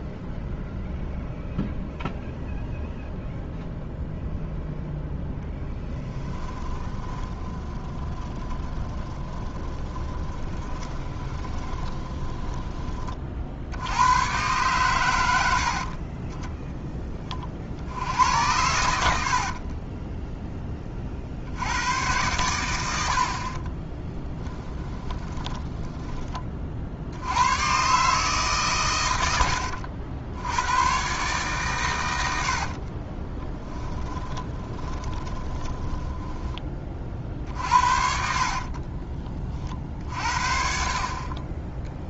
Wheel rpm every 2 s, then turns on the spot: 0, 0, 0, 20, 10, 20, 30, 120, 10, 80, 30, 90, 10, 50, 120, 110, 40, 20, 30, 30, 50.
6-12 18-20 24-26 32-36 38-40